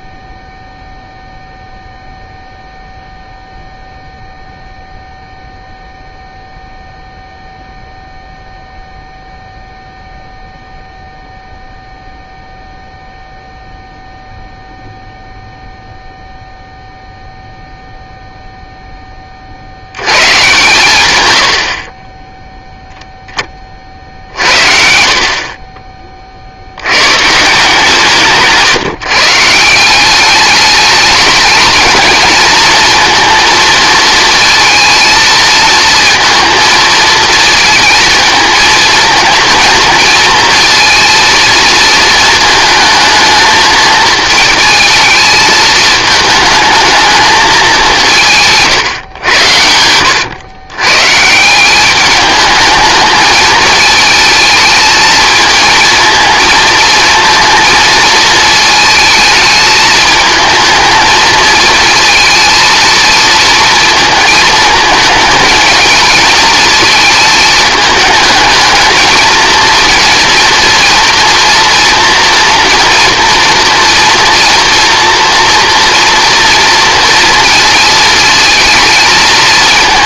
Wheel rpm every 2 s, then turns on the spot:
0, 0, 0, 0, 0, 0, 0, 0, 0, 0, 120, 0, 50, 80, 150, 210, 230, 230, 220, 220, 230, 220, 220, 220, 150, 120, 220, 220, 220, 220, 220, 230, 220, 220, 220, 240, 230, 230, 230, 230.
none